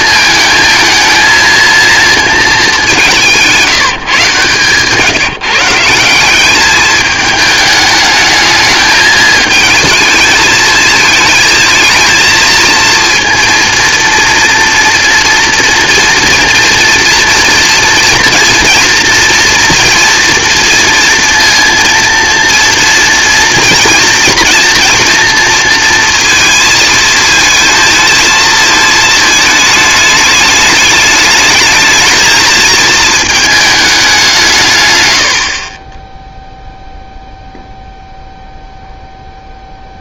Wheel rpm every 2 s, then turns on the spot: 220, 210, 140, 210, 220, 220, 230, 230, 230, 230, 230, 230, 230, 220, 220, 210, 230, 140, 0, 0.
4-6